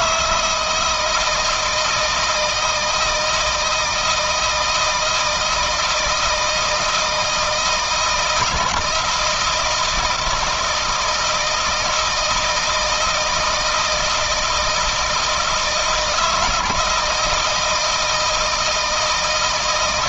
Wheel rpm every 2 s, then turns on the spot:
170, 160, 160, 160, 160, 160, 160, 160, 160, 160.
none